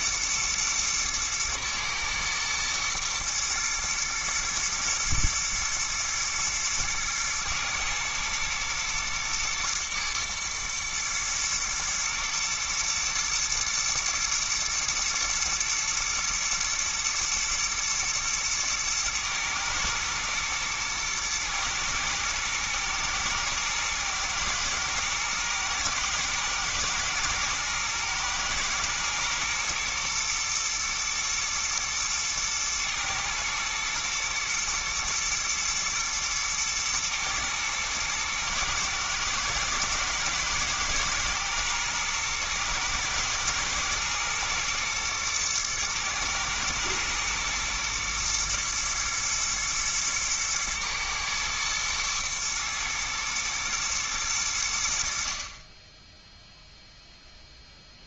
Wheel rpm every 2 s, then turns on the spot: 110, 120, 110, 120, 110, 120, 120, 110, 120, 110, 120, 110, 110, 110, 110, 110, 110, 120, 110, 110, 110, 110, 120, 110, 120, 110, 120, 80, 0.
none